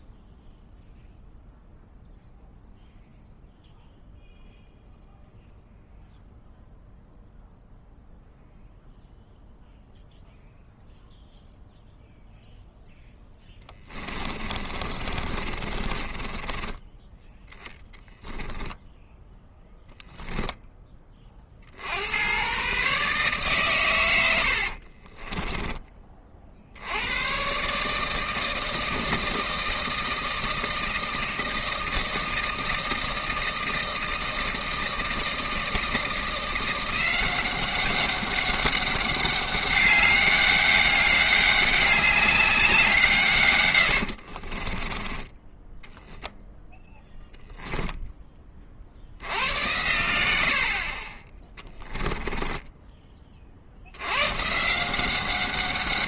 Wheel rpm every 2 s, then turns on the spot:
0, 0, 0, 0, 0, 0, 0, 30, 10, 10, 10, 130, 60, 70, 160, 160, 160, 160, 170, 200, 200, 180, 30, 10, 40, 60, 10, 160.
14-16 18-20 24-26 44-46